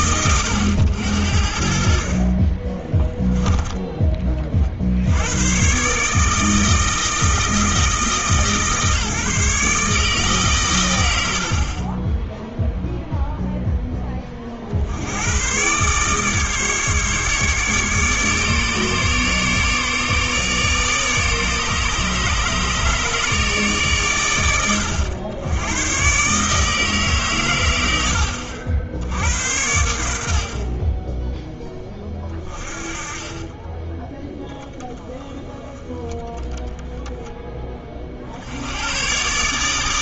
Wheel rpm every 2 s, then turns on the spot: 90, 20, 40, 160, 150, 130, 0, 50, 150, 150, 150, 150, 90, 150, 60, 50, 30, 10, 10, 80.
none